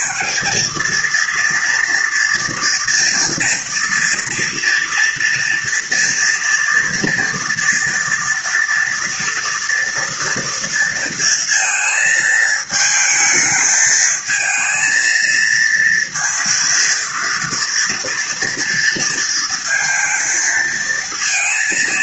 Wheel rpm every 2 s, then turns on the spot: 220, 230, 240, 240, 230, 230, 220, 220, 230, 230, 230.
none